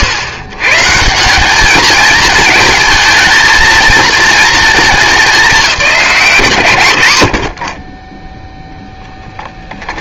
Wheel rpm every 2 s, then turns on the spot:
150, 210, 220, 120, 0.
none